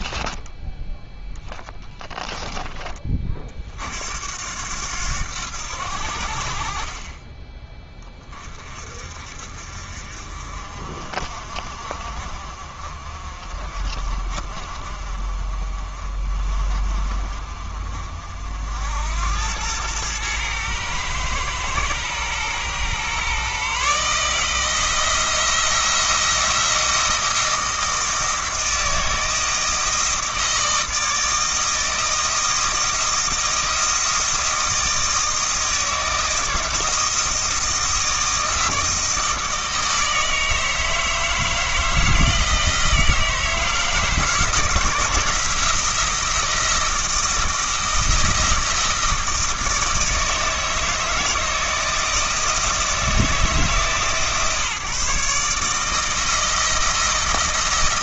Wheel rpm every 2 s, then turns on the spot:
10, 10, 80, 50, 40, 50, 50, 40, 40, 70, 110, 120, 160, 160, 160, 160, 160, 160, 160, 160, 160, 160, 160, 160, 160, 160, 160, 140, 160.
0-2